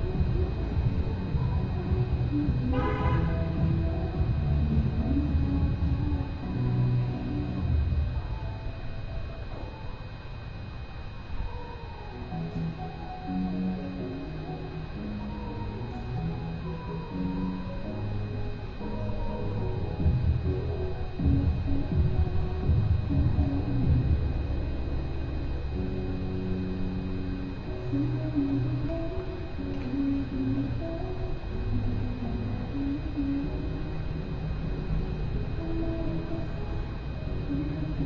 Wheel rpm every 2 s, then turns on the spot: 0, 0, 0, 0, 0, 0, 0, 0, 0, 0, 0, 0, 0, 0, 0, 0, 0, 0, 0.
none